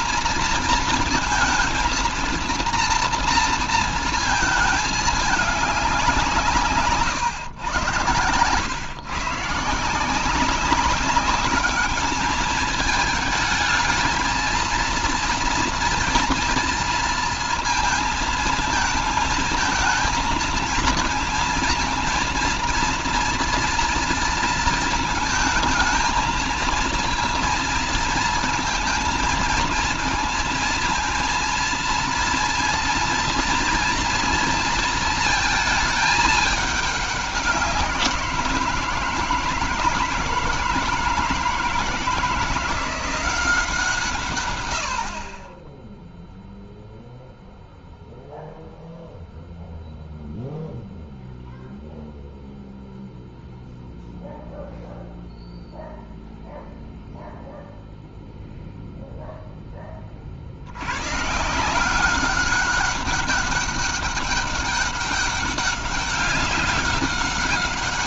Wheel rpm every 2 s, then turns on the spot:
230, 230, 220, 160, 120, 190, 220, 230, 230, 230, 230, 230, 230, 230, 220, 230, 230, 230, 210, 170, 170, 170, 100, 0, 0, 0, 0, 0, 0, 0, 80, 200, 200, 200.
none